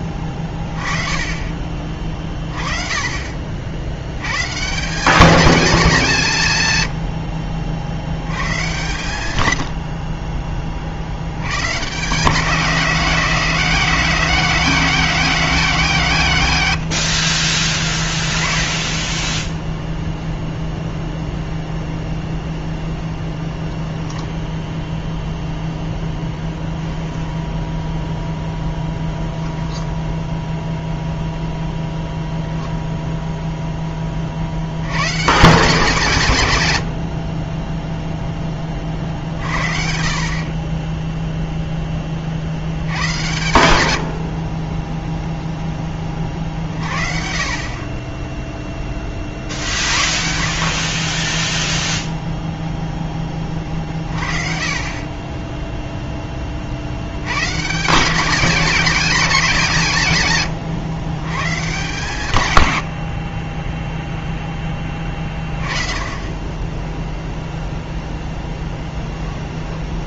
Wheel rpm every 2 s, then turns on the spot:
20, 30, 150, 120, 130, 40, 180, 190, 90, 10, 0, 0, 0, 10, 0, 0, 0, 100, 110, 20, 20, 70, 10, 40, 10, 30, 0, 40, 40, 220, 150, 100, 10, 10, 10.
68-70